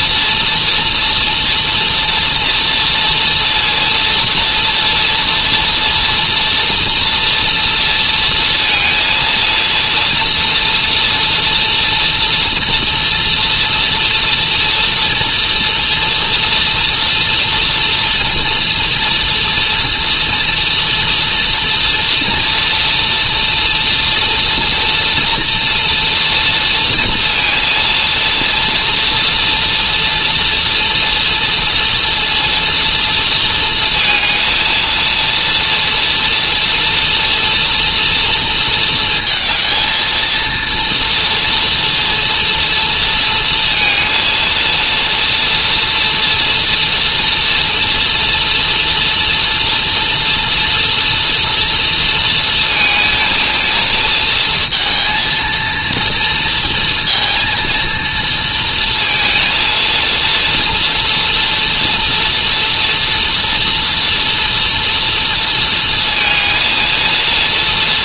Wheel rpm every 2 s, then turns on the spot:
230, 230, 240, 230, 230, 230, 230, 240, 230, 230, 230, 230, 240, 230, 230, 230, 230, 230, 230, 230, 230, 230, 230, 240, 230, 230, 220, 230, 230, 230, 230, 230, 240, 230.
none